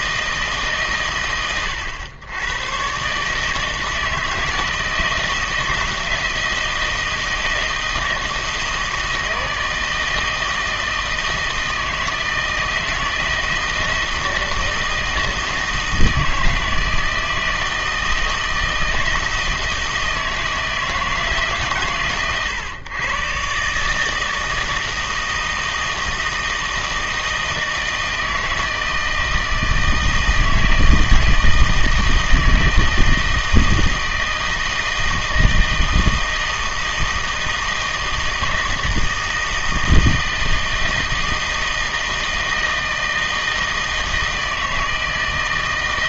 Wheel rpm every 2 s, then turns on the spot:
140, 120, 160, 160, 160, 160, 160, 160, 160, 160, 160, 130, 160, 160, 160, 160, 160, 160, 160, 160, 160, 160, 160.
none